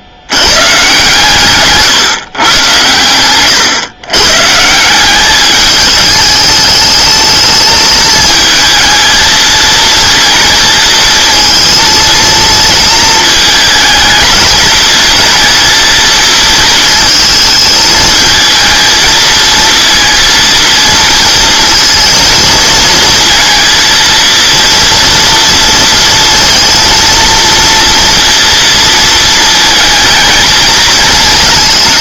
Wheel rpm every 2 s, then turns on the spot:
120, 110, 170, 210, 220, 230, 230, 220, 220, 220, 230, 230, 230, 230, 230, 220.
none